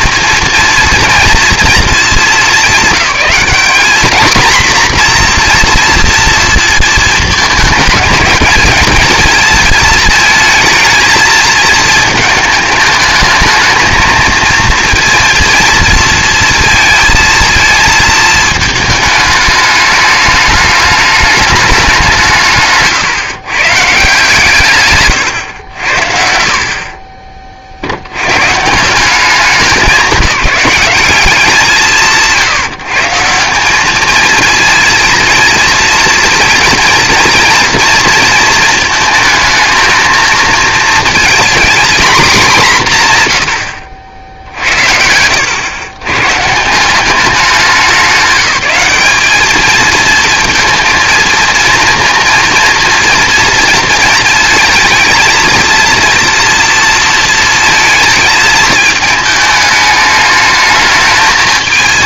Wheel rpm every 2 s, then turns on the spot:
230, 210, 250, 230, 220, 220, 210, 230, 230, 220, 210, 150, 140, 50, 160, 190, 160, 230, 230, 220, 230, 190, 60, 170, 210, 220, 230, 220, 230, 220, 220.
none